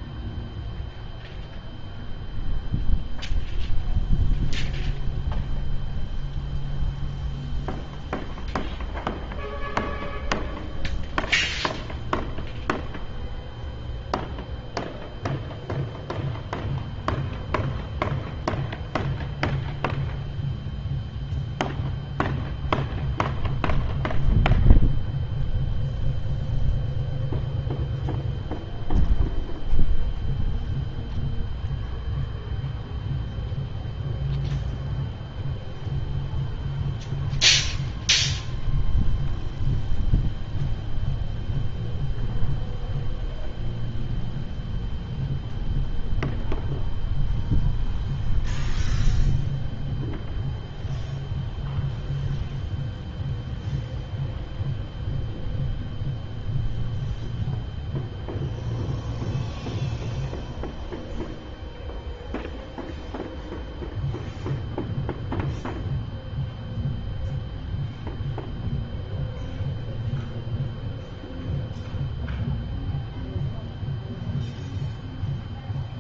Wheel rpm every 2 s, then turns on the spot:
0, 0, 0, 0, 0, 0, 0, 0, 0, 0, 0, 0, 0, 0, 0, 0, 0, 0, 0, 0, 0, 0, 0, 0, 0, 0, 0, 0, 0, 0, 0, 0, 0, 0, 0, 0, 0, 0.
none